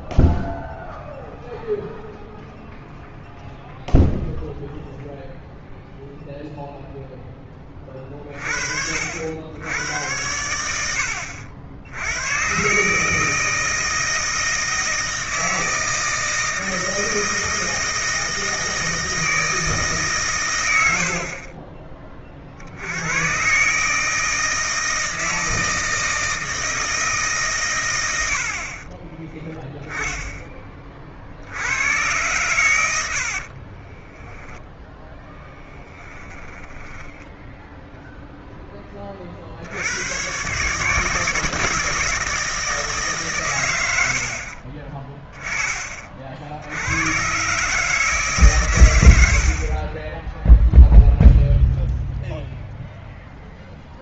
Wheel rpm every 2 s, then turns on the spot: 0, 0, 0, 0, 50, 80, 140, 160, 160, 160, 80, 70, 160, 160, 40, 10, 110, 10, 10, 10, 140, 160, 50, 60, 130, 0, 0.
34-38 44-46